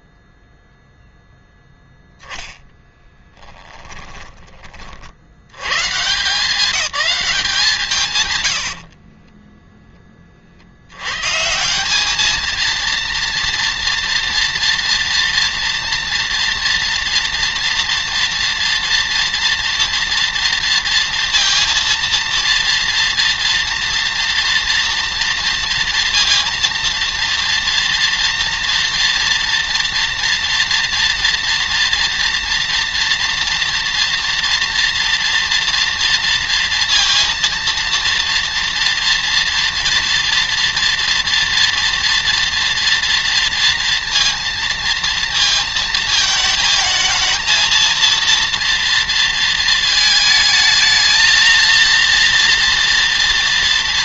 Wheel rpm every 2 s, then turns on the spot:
0, 10, 20, 190, 70, 60, 220, 230, 230, 230, 230, 240, 230, 230, 230, 230, 230, 230, 230, 230, 230, 230, 230, 220, 230, 220, 240.
8-10